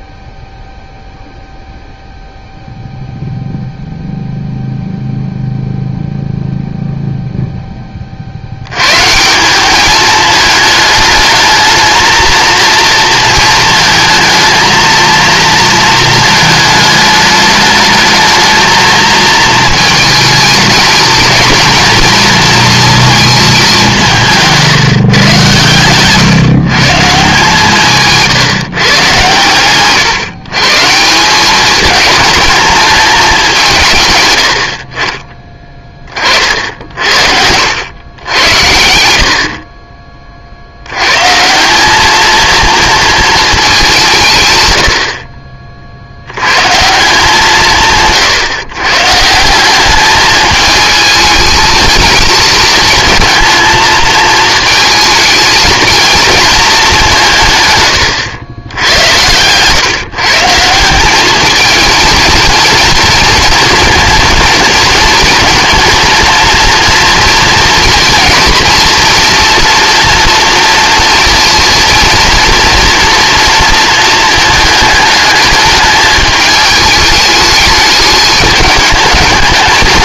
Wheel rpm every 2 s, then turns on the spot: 0, 0, 0, 0, 110, 210, 230, 230, 220, 230, 220, 230, 160, 150, 130, 140, 220, 70, 60, 80, 80, 220, 110, 150, 140, 220, 220, 220, 210, 100, 170, 230, 230, 230, 230, 230, 240, 220, 210, 210.
none